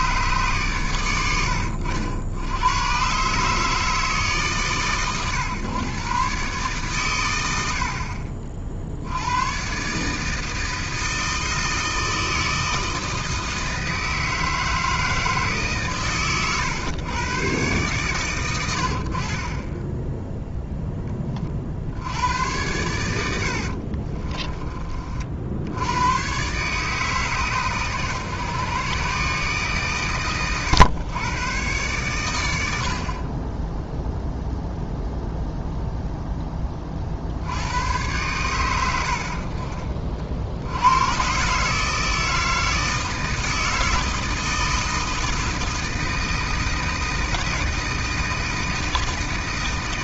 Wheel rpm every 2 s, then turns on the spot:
130, 100, 140, 140, 50, 160, 160, 160, 120, 110, 0, 90, 40, 120, 120, 110, 90, 0, 10, 110, 60, 160, 160, 160, 160.
24-26